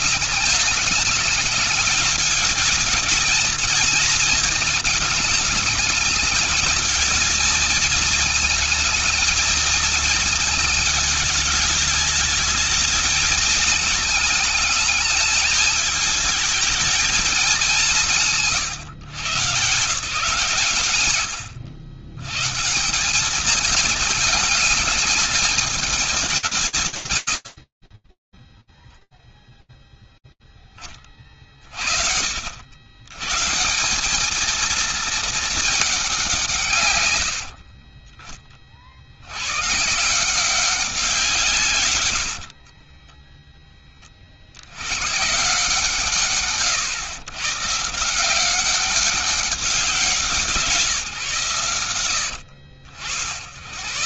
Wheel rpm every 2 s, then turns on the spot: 210, 220, 220, 220, 220, 220, 210, 220, 220, 160, 140, 130, 210, 180, 10, 0, 60, 210, 180, 30, 170, 70, 80, 120, 180, 180, 60.
42-44